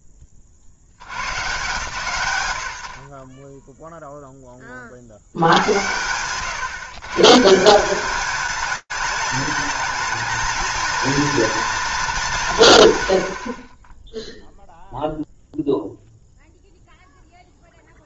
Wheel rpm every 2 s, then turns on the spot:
100, 30, 70, 140, 220, 230, 100, 0, 0.
none